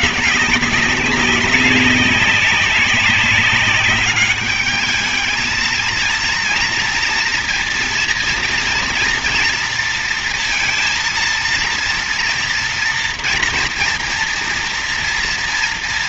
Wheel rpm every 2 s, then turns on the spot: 200, 200, 210, 230, 230, 230, 230, 230.
none